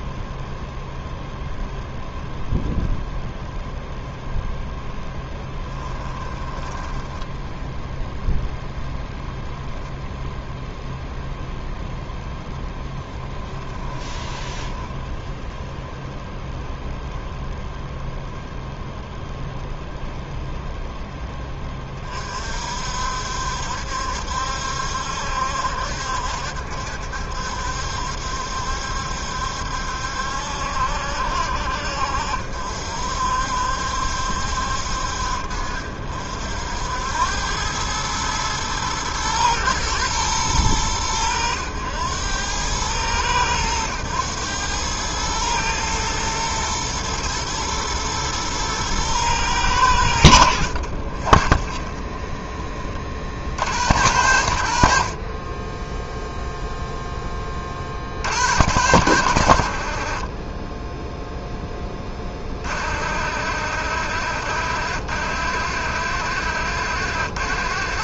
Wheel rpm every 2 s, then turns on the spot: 0, 0, 0, 10, 0, 0, 10, 10, 0, 0, 0, 60, 70, 70, 70, 70, 60, 60, 70, 110, 100, 100, 110, 110, 110, 60, 10, 80, 0, 70, 10, 50, 80, 90.
6-8 14-16 50-54